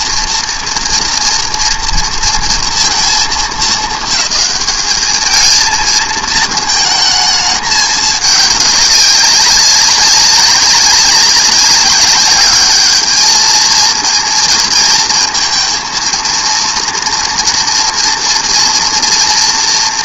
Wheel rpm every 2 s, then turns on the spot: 230, 230, 200, 220, 200, 190, 200, 230, 230, 240.
none